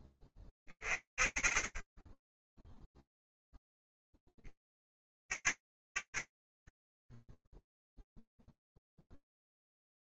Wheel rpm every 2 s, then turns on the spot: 10, 10, 20, 40, 0.
none